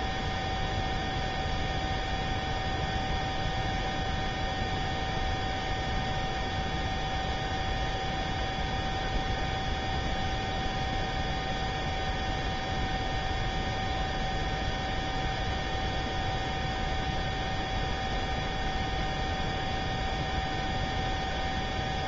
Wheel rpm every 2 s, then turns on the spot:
0, 0, 0, 0, 0, 0, 0, 0, 0, 0, 0.
none